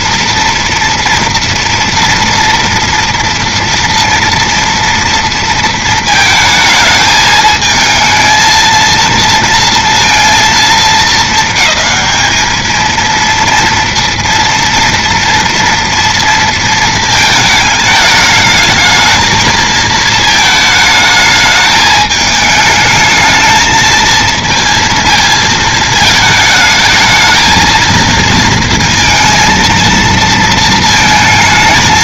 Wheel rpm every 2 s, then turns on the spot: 230, 230, 230, 220, 220, 230, 220, 230, 230, 220, 220, 220, 220, 220, 230, 230.
none